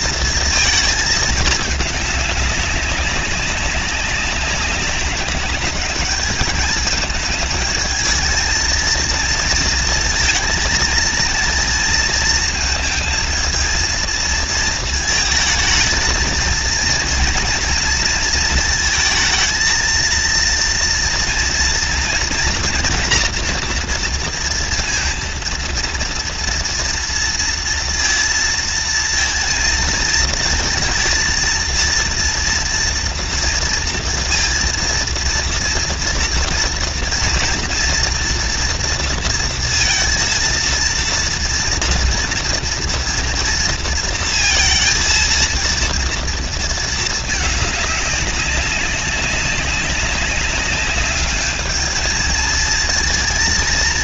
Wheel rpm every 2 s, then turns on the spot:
230, 200, 190, 210, 220, 230, 230, 230, 230, 230, 230, 230, 230, 230, 230, 220, 230, 230, 240, 240, 230, 230, 230, 230, 200, 200, 220.
none